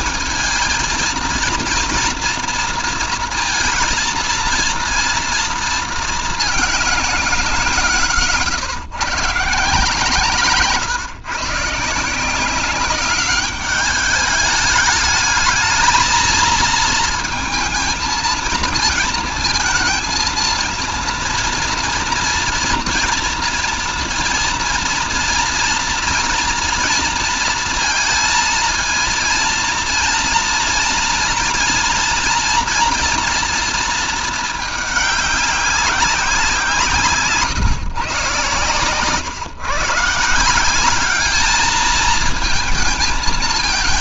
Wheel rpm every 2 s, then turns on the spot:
230, 230, 230, 190, 150, 130, 200, 210, 230, 230, 230, 230, 230, 230, 230, 230, 230, 200, 160, 130, 210, 220.
none